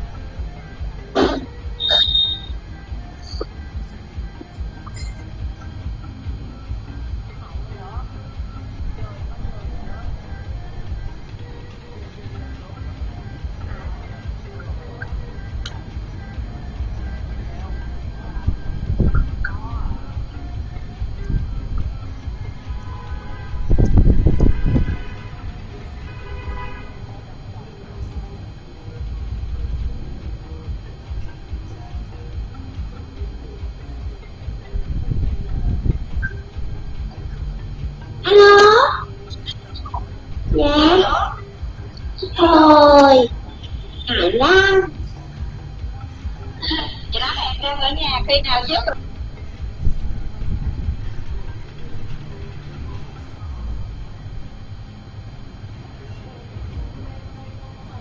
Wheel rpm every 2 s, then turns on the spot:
0, 0, 0, 0, 0, 0, 0, 0, 0, 0, 0, 0, 0, 0, 0, 0, 0, 0, 0, 0, 0, 0, 0, 0, 0, 0, 0, 0, 0.
none